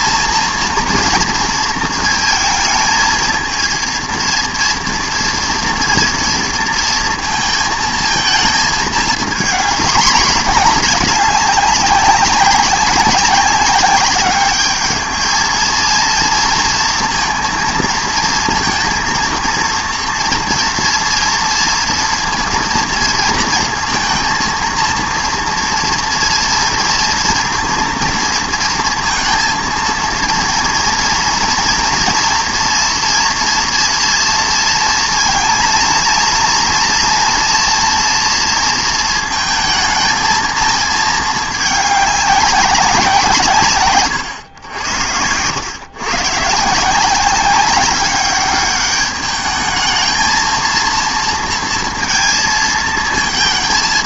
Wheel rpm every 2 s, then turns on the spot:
230, 220, 230, 230, 220, 210, 200, 200, 230, 230, 230, 230, 230, 230, 230, 230, 230, 230, 230, 230, 220, 200, 100, 150, 200, 220, 230.
none